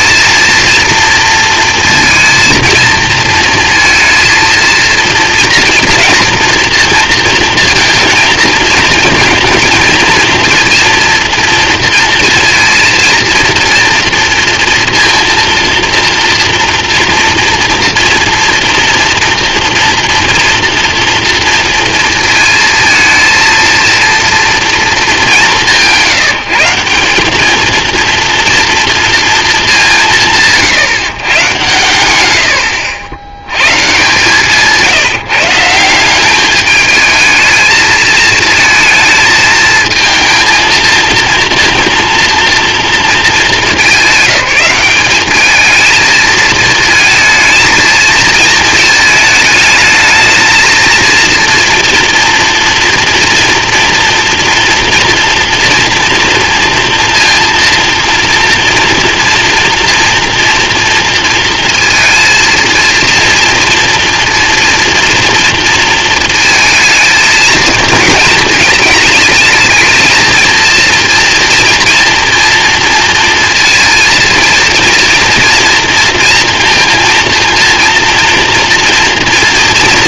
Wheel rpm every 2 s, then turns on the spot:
230, 230, 230, 230, 230, 230, 230, 230, 230, 230, 230, 220, 220, 180, 230, 150, 80, 160, 210, 220, 230, 220, 200, 220, 220, 230, 230, 230, 230, 230, 230, 230, 230, 220, 220, 230, 230, 230, 230, 230.
32-34